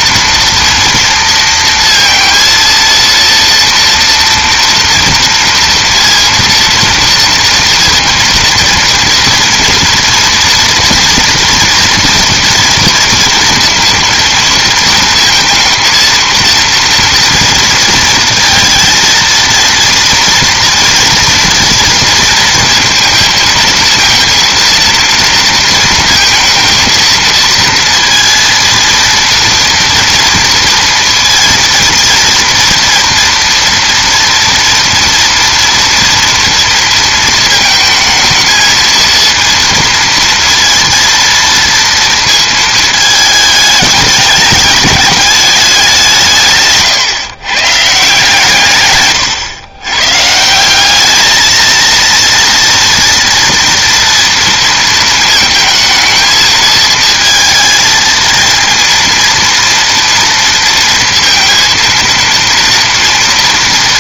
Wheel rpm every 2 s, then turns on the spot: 230, 230, 230, 230, 230, 230, 230, 230, 230, 230, 230, 230, 230, 220, 230, 230, 230, 230, 230, 220, 230, 220, 200, 150, 130, 190, 230, 230, 220, 230, 230, 230.
none